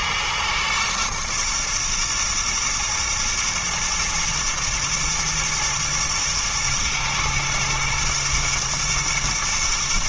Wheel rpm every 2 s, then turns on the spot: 120, 110, 120, 110, 110.
none